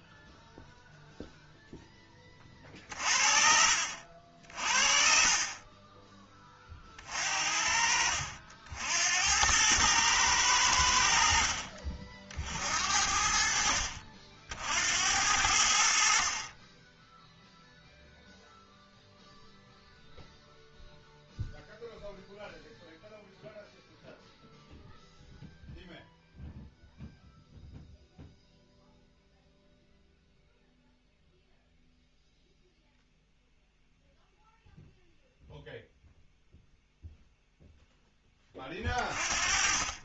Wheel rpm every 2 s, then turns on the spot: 0, 40, 60, 30, 60, 90, 60, 60, 30, 0, 0, 0, 0, 0, 0, 0, 0, 0, 0, 20.
none